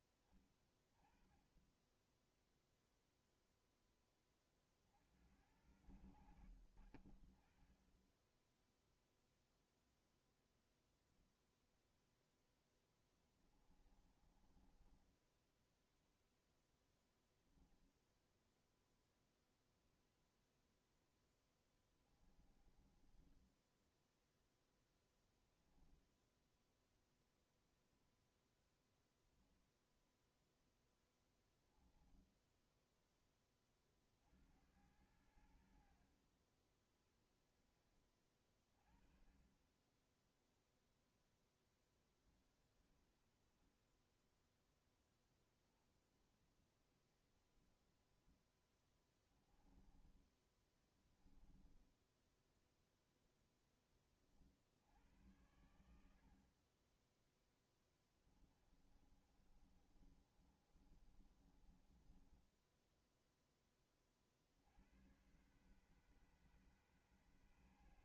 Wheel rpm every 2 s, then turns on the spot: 20, 10, 30, 80, 10, 0, 10, 20, 0, 10, 0, 10, 0, 10, 10, 0, 10, 70, 40, 30, 0, 30, 30, 20, 10, 20, 0, 50, 50, 20, 30, 20, 60, 130.
6-10 12-16 18-20 22-24 26-30 50-52 58-64